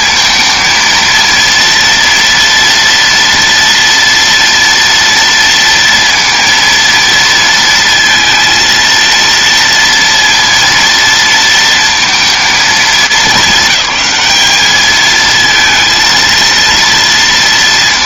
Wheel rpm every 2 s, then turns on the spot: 230, 230, 230, 230, 230, 230, 210, 210, 230.
none